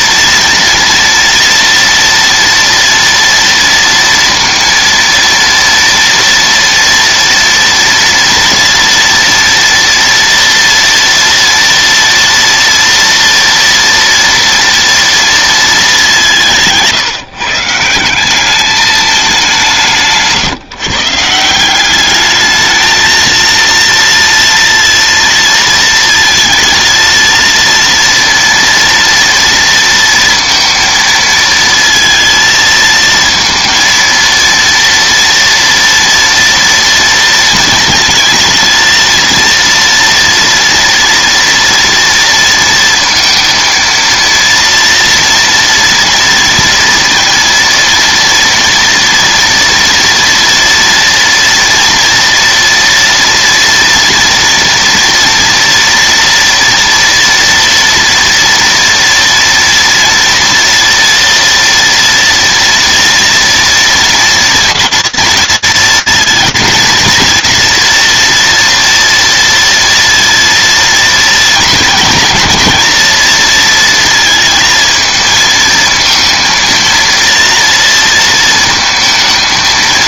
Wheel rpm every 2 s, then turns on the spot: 230, 230, 230, 230, 230, 230, 230, 230, 170, 210, 140, 220, 230, 220, 230, 230, 230, 230, 230, 230, 230, 230, 230, 230, 230, 230, 230, 230, 230, 230, 230, 230, 230, 230, 230, 230, 220, 220, 230, 230.
none